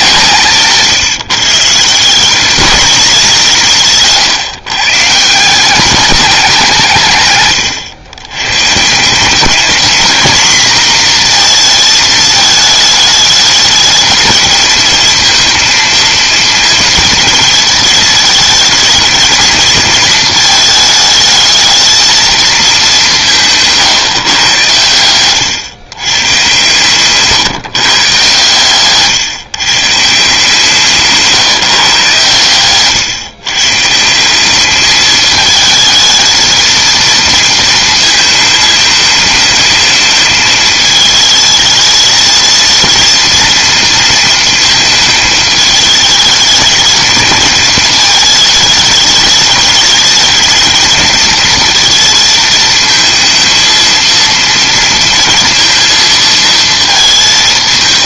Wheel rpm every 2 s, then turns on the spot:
160, 210, 150, 190, 130, 230, 220, 220, 230, 220, 220, 210, 120, 130, 130, 150, 120, 200, 220, 220, 220, 230, 230, 220, 220, 220, 220, 230, 220.
none